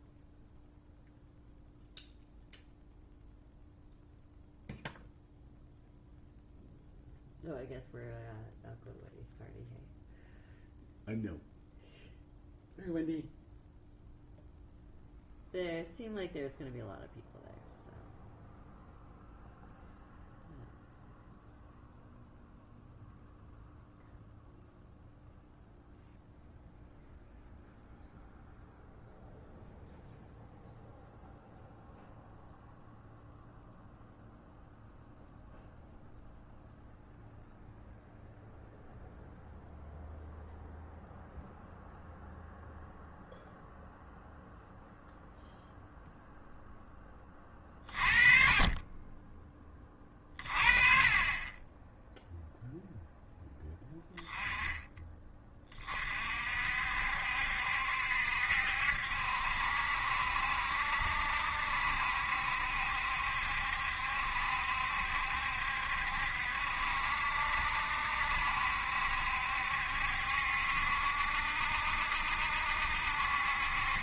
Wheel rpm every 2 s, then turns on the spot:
0, 0, 0, 0, 0, 0, 0, 0, 0, 0, 0, 0, 0, 0, 0, 0, 0, 0, 0, 0, 0, 0, 0, 10, 30, 30, 0, 10, 60, 70, 70, 70, 70, 70, 70, 70, 60.
none